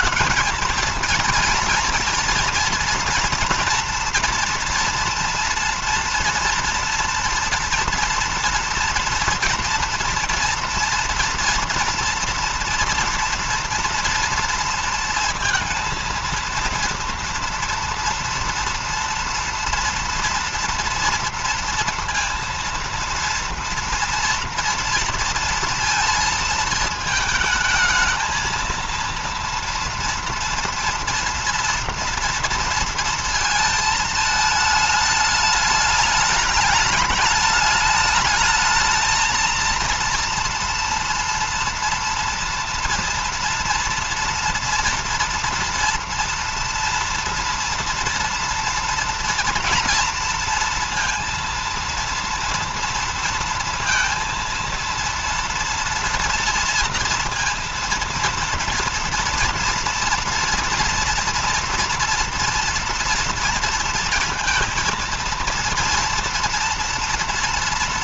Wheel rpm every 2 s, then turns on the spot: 230, 230, 230, 230, 240, 230, 230, 230, 230, 230, 230, 230, 230, 220, 230, 230, 230, 210, 200, 220, 230, 230, 230, 230, 240, 230, 230, 230, 230, 230, 230, 230, 230, 230.
none